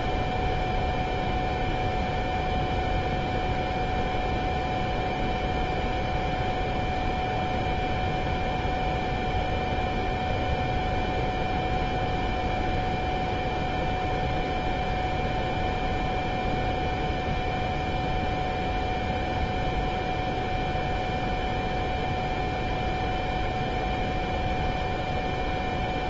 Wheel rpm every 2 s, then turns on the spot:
0, 0, 0, 0, 0, 0, 0, 0, 0, 0, 0, 0, 0.
none